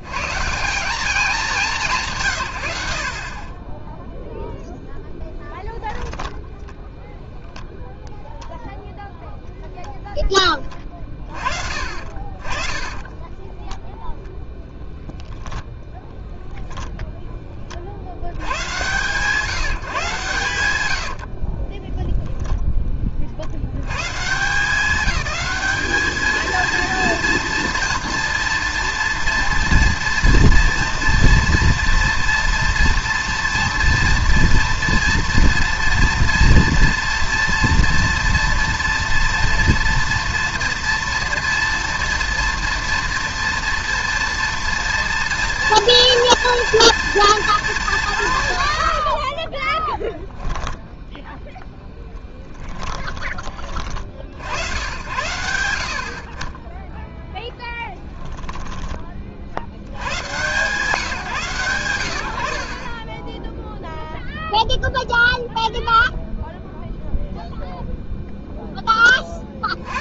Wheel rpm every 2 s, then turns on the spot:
170, 80, 0, 0, 0, 20, 40, 0, 0, 110, 120, 10, 180, 230, 240, 240, 230, 230, 230, 230, 230, 230, 230, 230, 120, 10, 20, 80, 20, 10, 140, 60, 0, 0, 0.
10-14 20-22 50-54 58-60